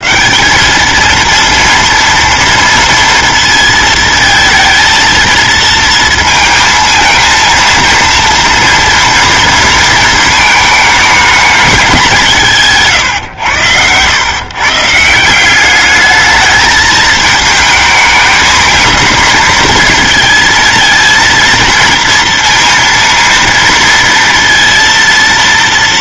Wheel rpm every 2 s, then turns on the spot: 210, 230, 220, 230, 230, 220, 150, 140, 220, 220, 230, 230, 230.
12-14